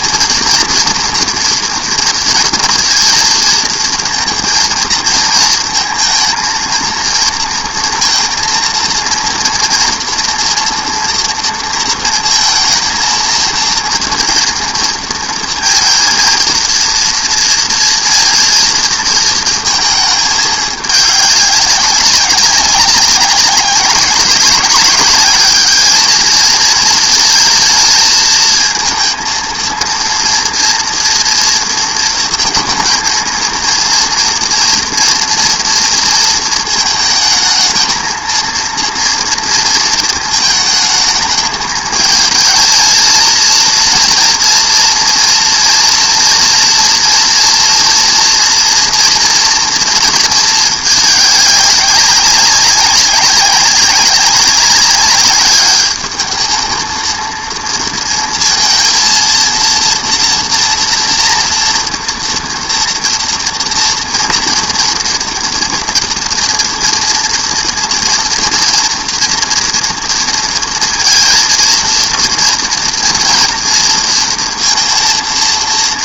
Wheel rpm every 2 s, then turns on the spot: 240, 230, 230, 230, 230, 230, 230, 230, 230, 230, 210, 200, 200, 220, 220, 230, 230, 230, 220, 230, 220, 220, 230, 230, 230, 220, 200, 200, 220, 230, 230, 230, 230, 240, 230, 230, 230, 230.
none